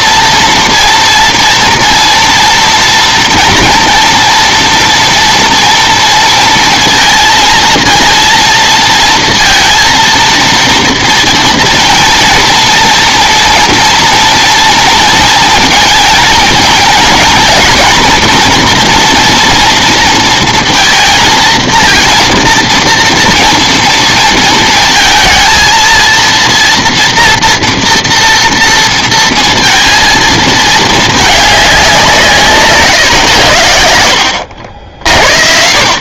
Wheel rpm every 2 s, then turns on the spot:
240, 230, 230, 230, 230, 230, 230, 230, 230, 240, 230, 230, 230, 230, 230, 220, 150, 70.
none